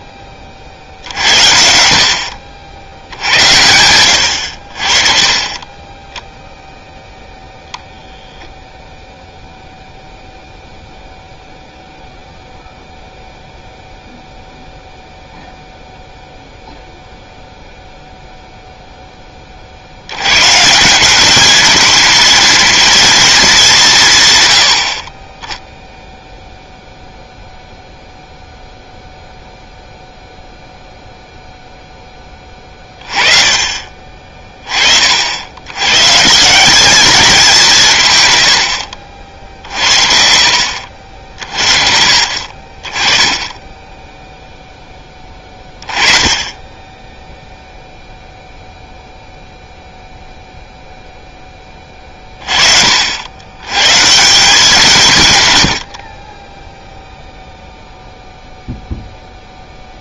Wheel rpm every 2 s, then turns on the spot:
80, 70, 80, 10, 0, 0, 0, 0, 0, 20, 200, 220, 20, 0, 0, 0, 20, 60, 200, 50, 50, 30, 10, 10, 0, 0, 60, 160, 0, 0.
none